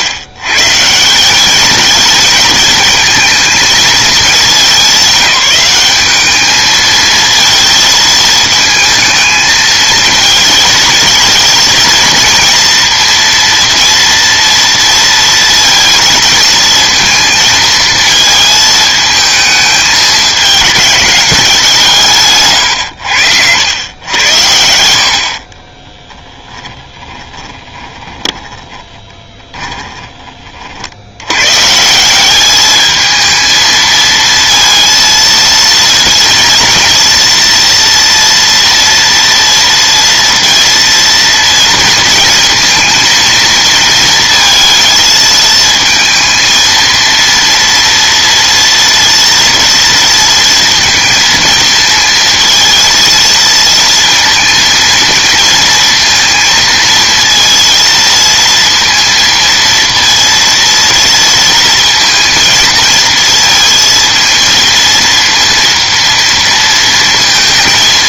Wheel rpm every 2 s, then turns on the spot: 140, 220, 200, 220, 220, 220, 230, 230, 230, 220, 210, 120, 80, 10, 20, 60, 210, 230, 230, 230, 230, 230, 220, 230, 230, 230, 230, 230, 230, 230, 230, 230, 230, 230.
22-24 26-30